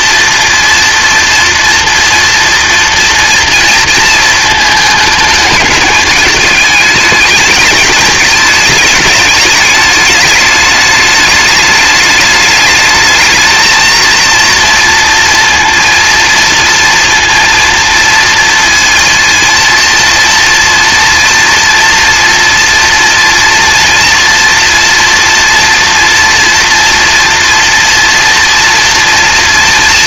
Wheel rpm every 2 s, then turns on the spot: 230, 230, 220, 210, 220, 210, 210, 230, 230, 230, 230, 230, 240, 240, 230.
none